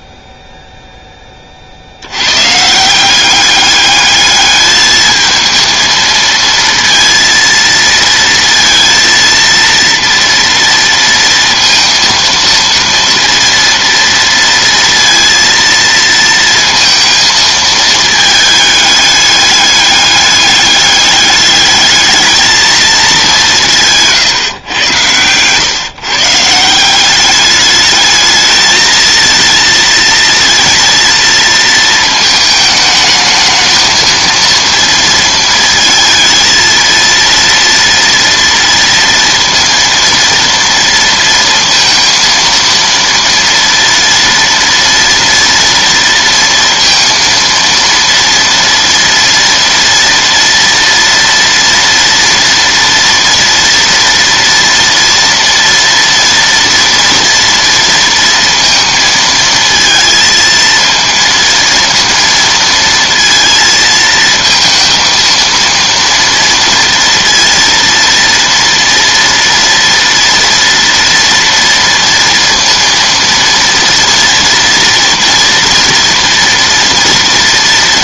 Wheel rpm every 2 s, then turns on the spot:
0, 160, 210, 230, 230, 230, 230, 230, 230, 210, 200, 220, 120, 170, 220, 230, 220, 230, 230, 230, 230, 230, 230, 230, 230, 230, 230, 230, 230, 230, 230, 230, 230, 230, 230, 230, 230, 230, 230.
none